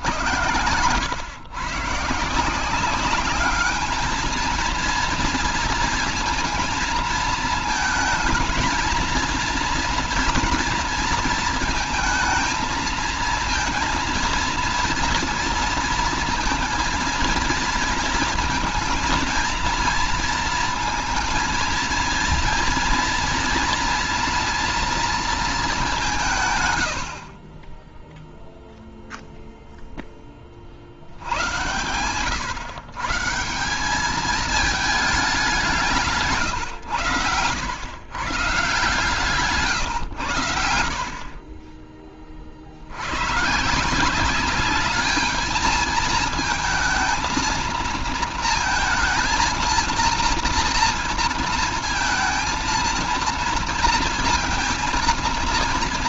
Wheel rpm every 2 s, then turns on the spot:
110, 170, 220, 230, 220, 230, 220, 230, 230, 230, 230, 230, 240, 150, 0, 20, 130, 210, 140, 140, 90, 50, 200, 220, 230, 230, 230, 230.
none